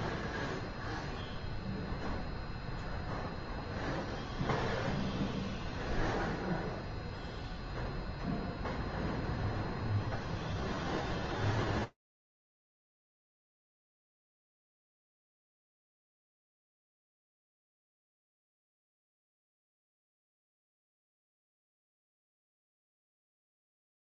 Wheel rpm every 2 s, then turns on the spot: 0, 0, 0, 0, 0, 0, 0, 0, 0, 0, 0, 0.
none